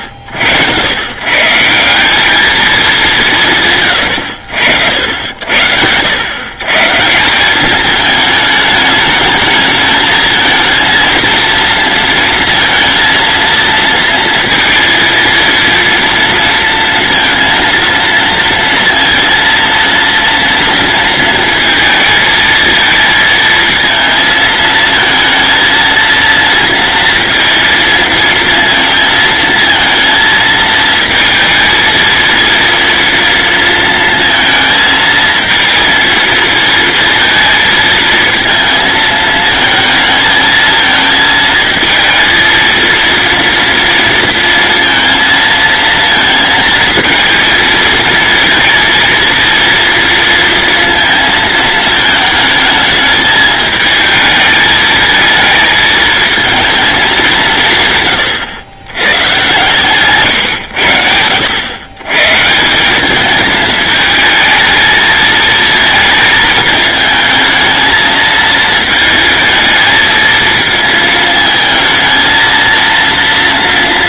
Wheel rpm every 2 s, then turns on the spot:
100, 200, 70, 140, 210, 230, 230, 230, 230, 230, 230, 220, 220, 230, 230, 220, 230, 230, 220, 220, 220, 230, 230, 230, 230, 230, 220, 220, 220, 110, 100, 180, 220, 220, 220, 220, 230.
none